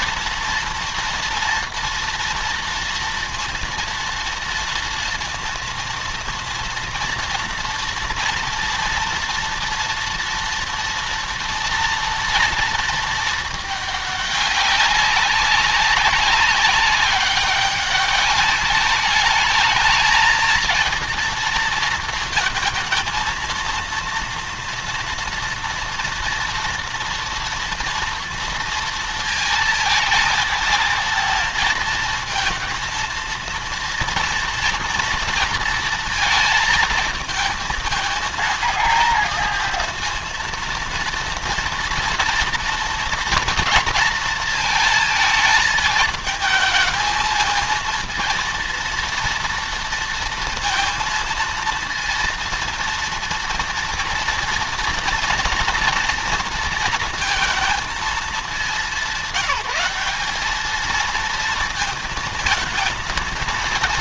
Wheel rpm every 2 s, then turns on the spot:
230, 230, 230, 230, 230, 230, 230, 200, 190, 200, 220, 230, 230, 230, 230, 220, 230, 230, 230, 230, 230, 240, 230, 220, 230, 230, 230, 230, 230, 220, 210, 220.
none